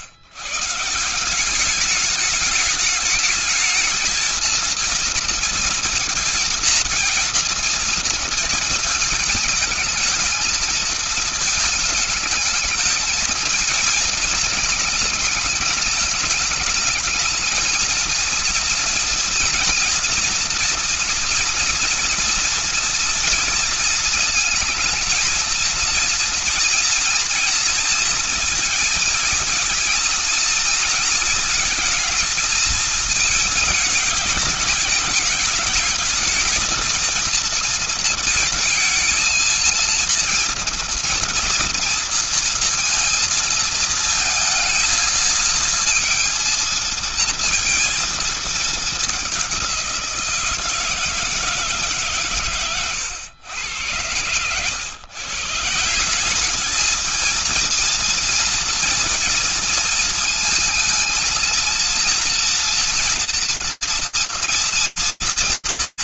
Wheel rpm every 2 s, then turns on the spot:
110, 210, 230, 230, 230, 220, 220, 230, 210, 230, 230, 230, 230, 230, 230, 220, 220, 210, 220, 230, 230, 230, 220, 230, 220, 170, 130, 110, 200, 230, 230, 230, 230.
none